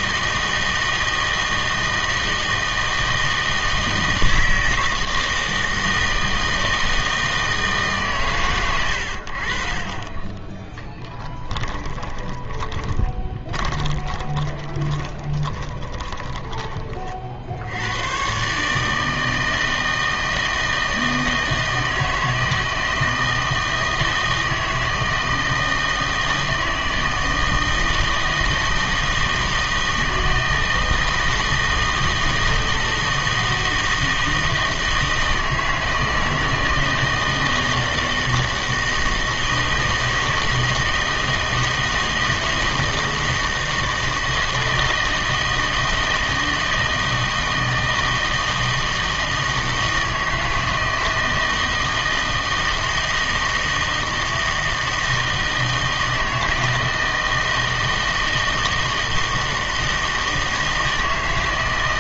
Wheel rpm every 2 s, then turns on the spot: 160, 160, 160, 160, 110, 10, 20, 30, 20, 140, 160, 160, 160, 160, 160, 160, 160, 160, 160, 160, 160, 160, 160, 160, 160, 160, 160, 160, 160, 160, 160.
10-16